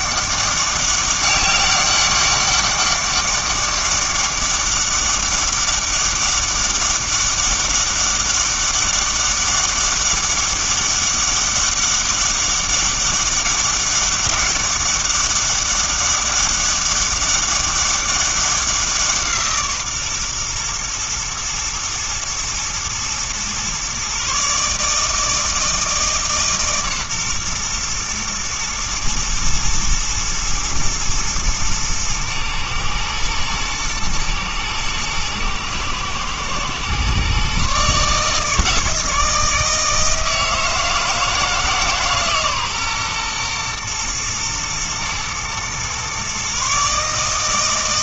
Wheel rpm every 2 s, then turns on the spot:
200, 200, 200, 200, 200, 200, 200, 200, 200, 190, 120, 120, 140, 140, 110, 120, 110, 110, 120, 160, 160, 140, 120, 140.
none